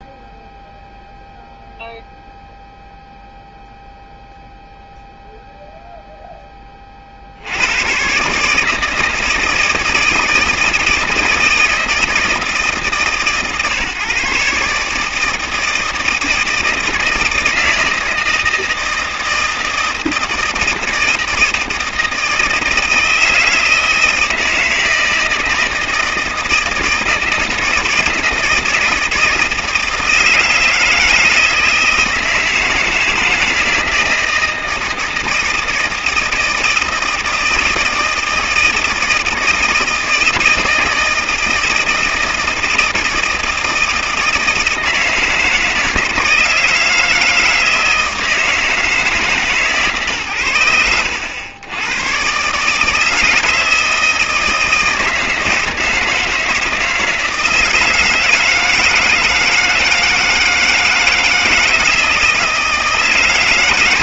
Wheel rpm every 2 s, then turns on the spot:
0, 0, 0, 20, 150, 160, 140, 140, 160, 160, 160, 160, 160, 160, 160, 160, 160, 160, 160, 160, 160, 160, 160, 160, 160, 100, 140, 160, 160, 160, 160, 160.
none